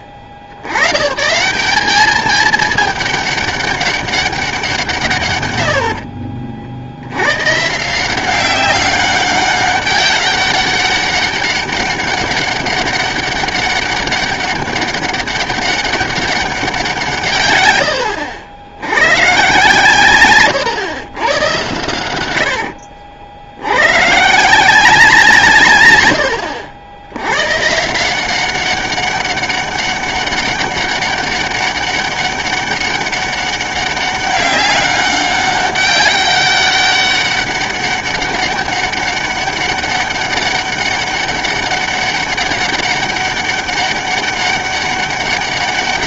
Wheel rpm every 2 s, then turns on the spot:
80, 210, 180, 60, 190, 200, 200, 200, 190, 100, 120, 80, 180, 90, 190, 200, 200, 200, 200, 190, 200, 190, 200.
22-24